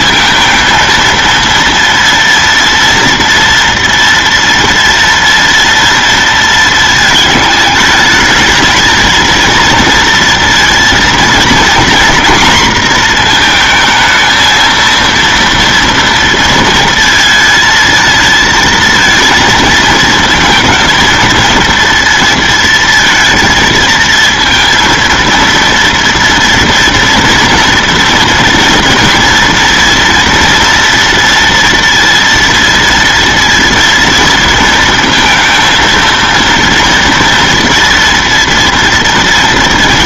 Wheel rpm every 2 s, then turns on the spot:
230, 230, 230, 220, 220, 230, 230, 230, 230, 230, 230, 230, 230, 230, 230, 230, 230, 230, 230, 230.
none